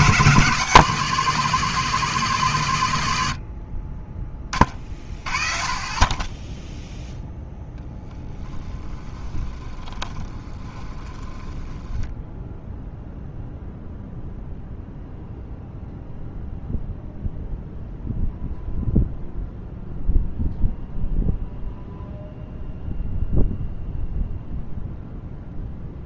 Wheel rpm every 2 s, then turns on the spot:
160, 130, 20, 10, 10, 20, 0, 0, 0, 0, 0, 0, 0.
10-12